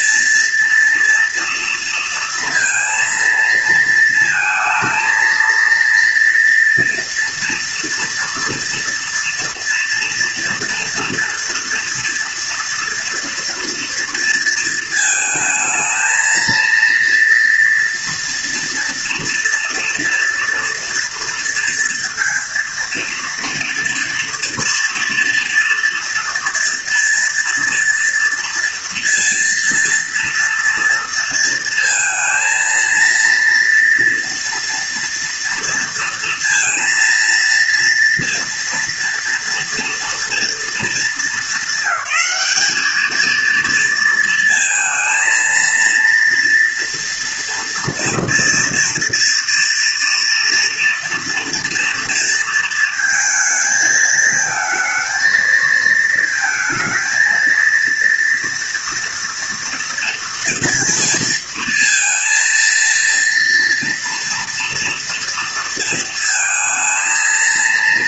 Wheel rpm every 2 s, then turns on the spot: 230, 230, 230, 230, 230, 240, 240, 220, 230, 230, 230, 230, 230, 230, 230, 230, 230, 230, 230, 230, 230, 220, 230, 230, 230, 230, 230, 220, 220, 230, 230, 230, 240, 230.
none